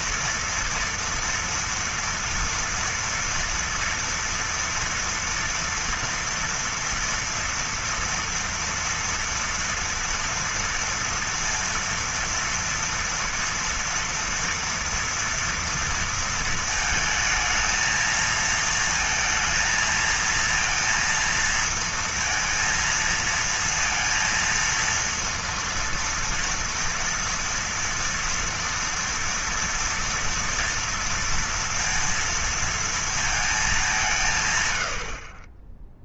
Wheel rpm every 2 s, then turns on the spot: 230, 230, 230, 230, 230, 230, 230, 230, 230, 220, 230, 230, 230, 230, 230, 230, 230, 130.
none